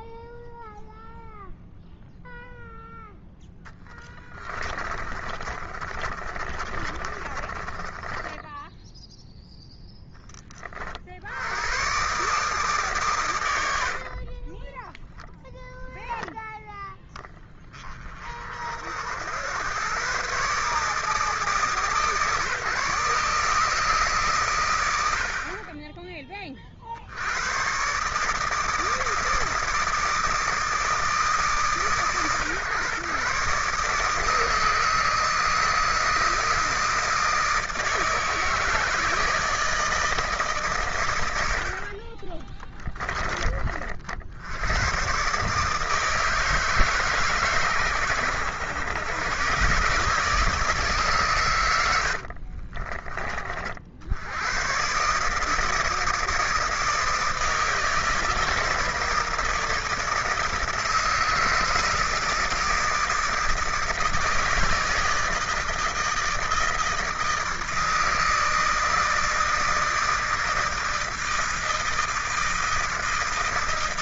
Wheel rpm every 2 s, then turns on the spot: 0, 0, 20, 30, 10, 30, 140, 30, 10, 50, 140, 150, 110, 30, 150, 160, 130, 160, 160, 160, 130, 20, 80, 160, 110, 150, 40, 110, 160, 160, 160, 160, 160, 160, 160, 160, 160.
4-10 14-16 42-44 52-54